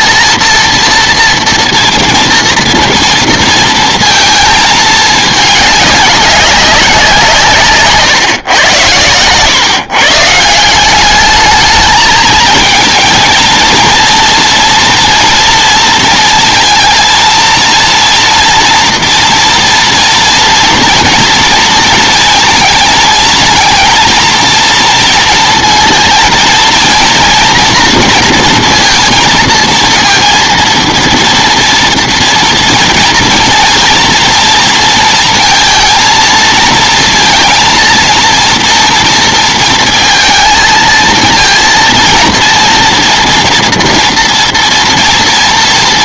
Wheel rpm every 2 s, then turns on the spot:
230, 230, 220, 190, 120, 180, 220, 230, 230, 230, 230, 220, 220, 230, 230, 230, 230, 230, 220, 230, 230, 230, 230.
none